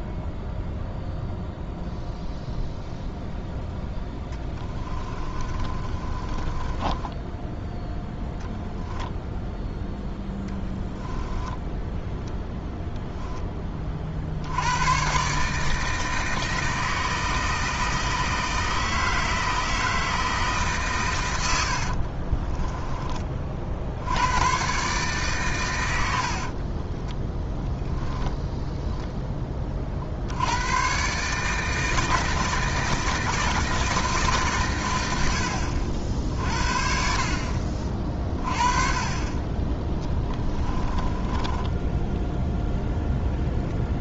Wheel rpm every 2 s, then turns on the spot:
0, 0, 20, 20, 0, 10, 0, 100, 160, 160, 140, 30, 130, 30, 0, 120, 160, 110, 50, 30, 20, 0.
4-8 10-12 22-24 26-28 40-42